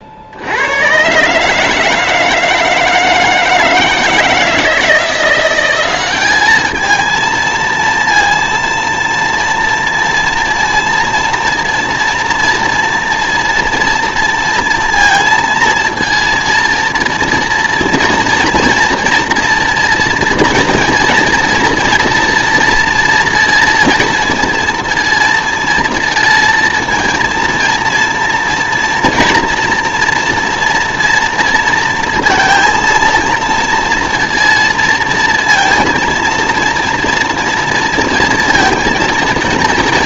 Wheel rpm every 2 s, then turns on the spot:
90, 160, 160, 210, 230, 230, 240, 230, 230, 230, 230, 240, 230, 230, 230, 230, 230, 230, 230, 230.
none